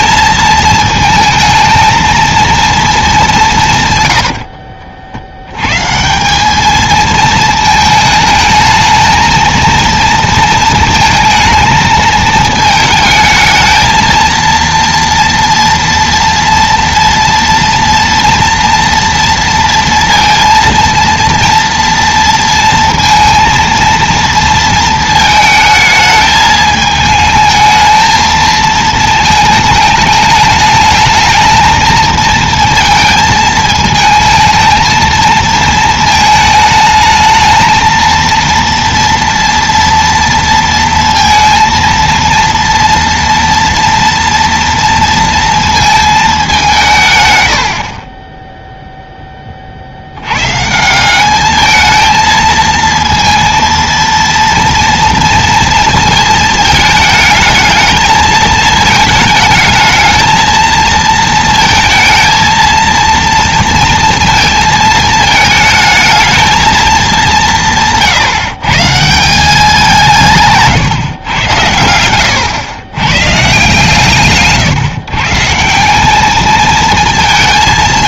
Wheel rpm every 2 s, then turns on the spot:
220, 220, 50, 220, 220, 230, 220, 230, 230, 230, 230, 230, 230, 220, 220, 220, 230, 220, 220, 230, 230, 230, 230, 170, 0, 160, 230, 230, 220, 220, 220, 230, 220, 220, 150, 140, 110, 140, 220.
none